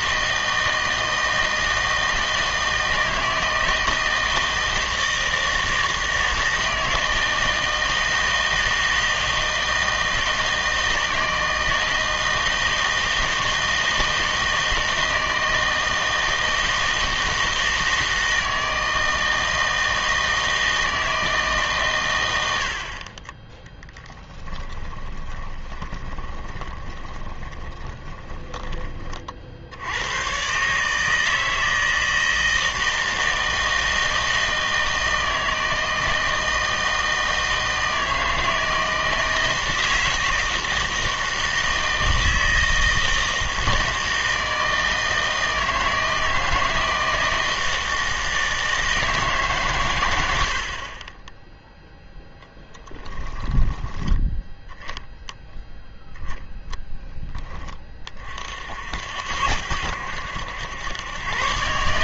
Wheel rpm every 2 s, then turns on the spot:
160, 160, 160, 160, 160, 160, 160, 160, 160, 160, 160, 70, 10, 20, 20, 130, 160, 160, 160, 160, 160, 160, 160, 160, 160, 60, 10, 10, 0, 60, 100.
24-30 50-54